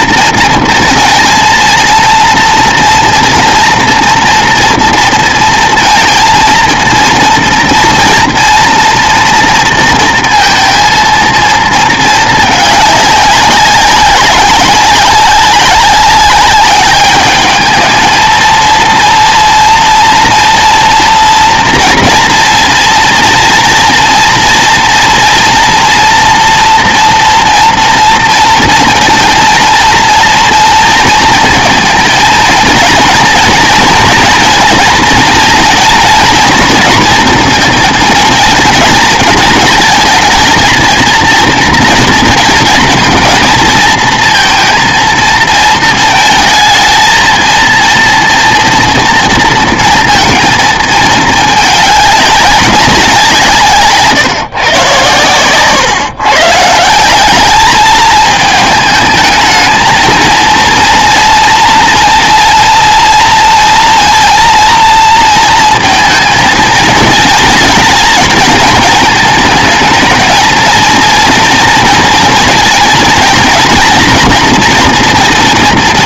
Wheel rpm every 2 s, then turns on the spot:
230, 230, 230, 230, 230, 230, 210, 190, 200, 230, 230, 230, 230, 230, 230, 220, 230, 230, 230, 220, 230, 230, 230, 220, 230, 220, 190, 130, 160, 220, 230, 230, 230, 230, 220, 230, 240, 230.
none